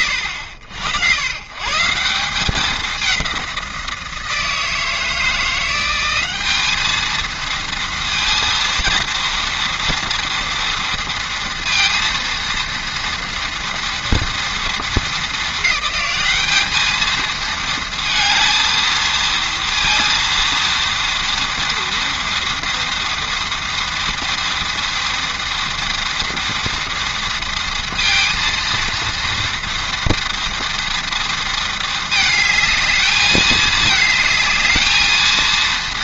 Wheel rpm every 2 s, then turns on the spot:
90, 190, 160, 210, 230, 230, 230, 220, 220, 230, 230, 230, 230, 230, 230, 230, 220, 220.
none